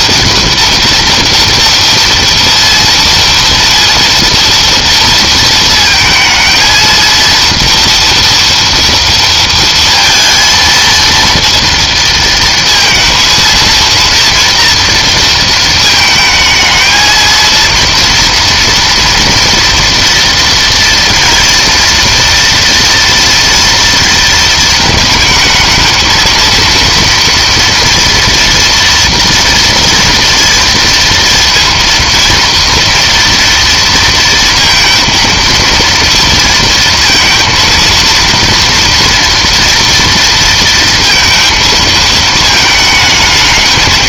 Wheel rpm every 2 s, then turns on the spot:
230, 230, 230, 230, 230, 230, 230, 230, 220, 230, 230, 230, 220, 230, 240, 230, 230, 230, 230, 230, 230, 220.
none